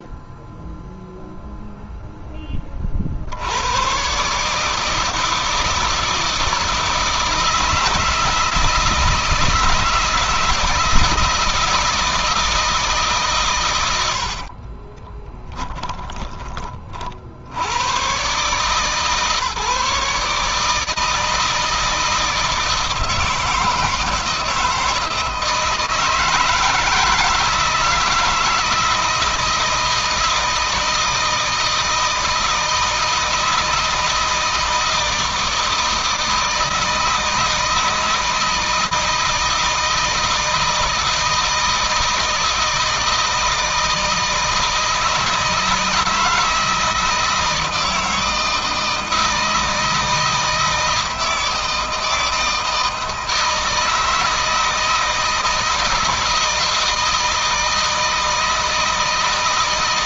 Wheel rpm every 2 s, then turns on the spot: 0, 60, 160, 160, 160, 160, 140, 30, 50, 150, 160, 160, 160, 160, 170, 160, 160, 160, 160, 160, 160, 160, 160, 160, 160, 160, 160, 160, 160, 160.
14-16